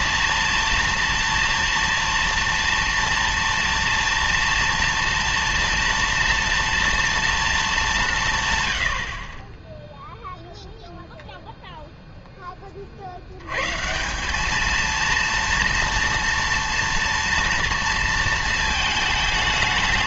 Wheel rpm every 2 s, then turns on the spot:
230, 230, 230, 240, 100, 0, 20, 210, 230, 230.
none